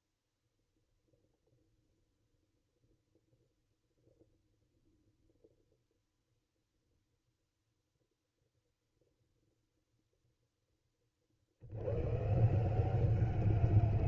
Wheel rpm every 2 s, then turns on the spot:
0, 0, 0, 0, 0, 10, 160.
none